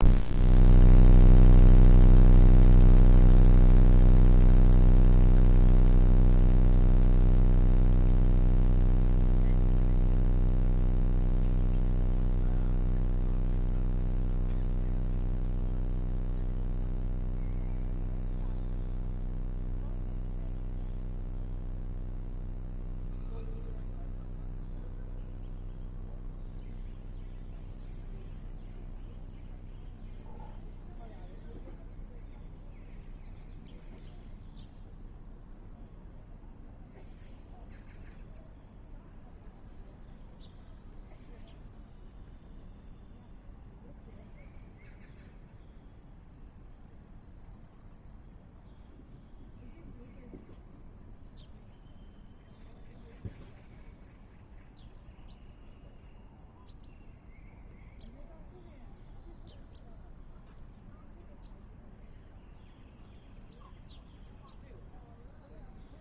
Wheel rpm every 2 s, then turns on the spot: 0, 0, 0, 0, 0, 0, 0, 0, 0, 0, 0, 0, 0, 0, 0, 0, 0, 0, 0, 0, 0, 0, 0, 0, 0, 0, 0, 0, 0, 0, 0, 0, 0.
none